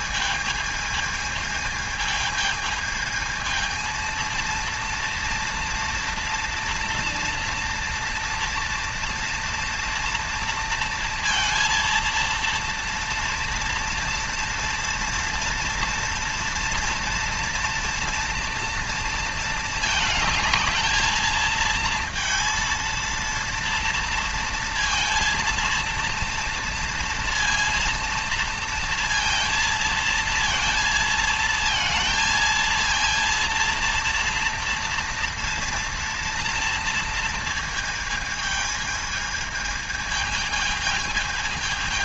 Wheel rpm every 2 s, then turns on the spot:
220, 220, 230, 230, 230, 230, 230, 230, 230, 230, 220, 230, 230, 230, 230, 230, 230, 230, 230, 220, 220.
none